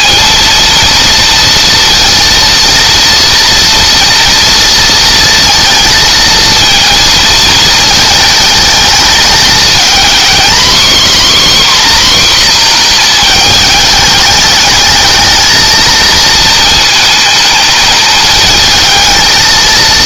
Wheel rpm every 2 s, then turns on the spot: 230, 230, 230, 220, 210, 270, 230, 220, 220, 220.
none